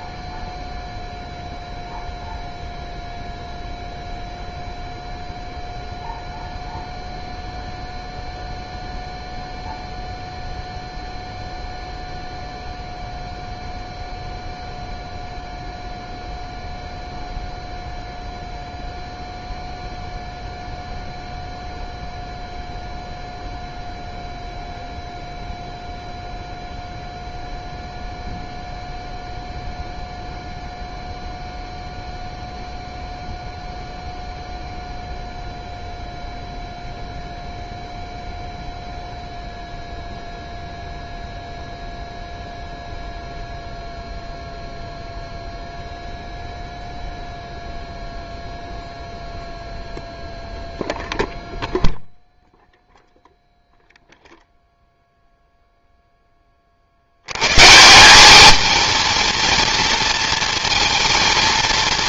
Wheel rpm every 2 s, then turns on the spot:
0, 0, 0, 0, 0, 0, 0, 0, 0, 0, 0, 0, 0, 0, 0, 0, 0, 0, 0, 0, 0, 0, 0, 0, 0, 0, 0, 0, 50, 220, 220.
none